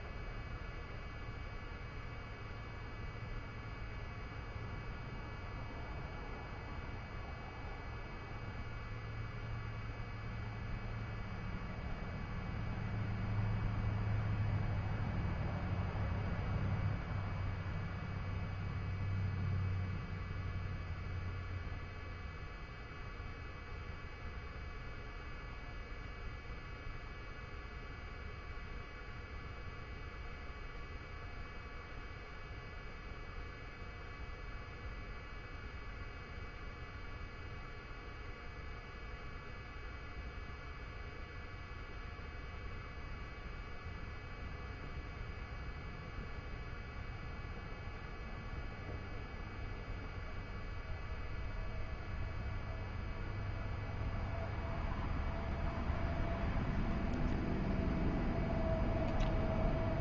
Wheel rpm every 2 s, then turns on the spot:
0, 0, 0, 0, 0, 0, 0, 0, 0, 0, 0, 0, 0, 0, 0, 0, 0, 0, 0, 0, 0, 0, 0, 0, 0, 0, 0, 0, 0, 0.
none